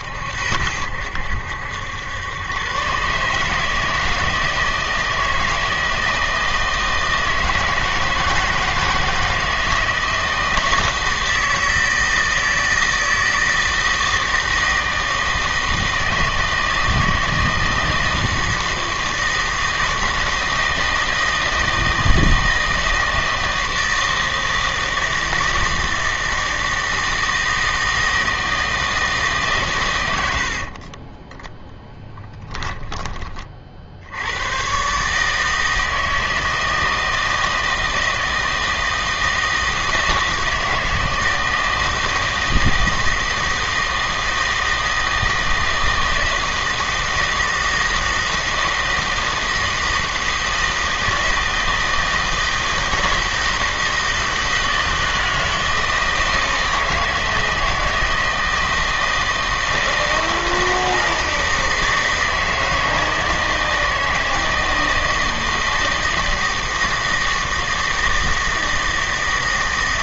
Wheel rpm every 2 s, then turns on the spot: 80, 120, 160, 160, 160, 160, 160, 160, 160, 160, 160, 160, 160, 160, 160, 50, 10, 120, 160, 160, 160, 160, 160, 160, 160, 160, 160, 160, 160, 160, 160, 160, 160, 160, 160.
30-34